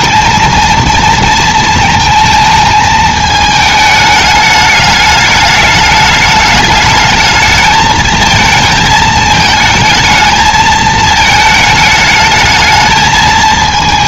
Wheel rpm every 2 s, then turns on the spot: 230, 220, 210, 220, 220, 220, 220.
none